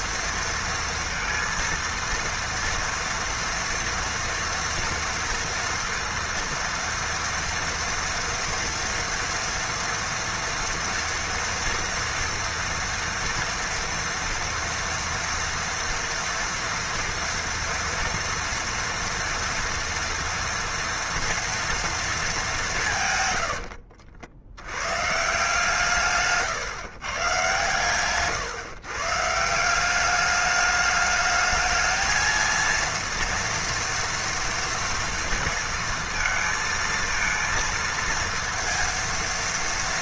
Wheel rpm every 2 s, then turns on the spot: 230, 230, 230, 230, 230, 230, 230, 230, 230, 230, 230, 180, 100, 130, 130, 210, 230, 230, 230, 230.
none